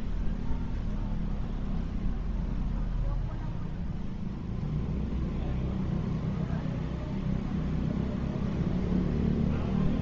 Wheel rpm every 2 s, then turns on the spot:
0, 0, 0, 0, 0.
none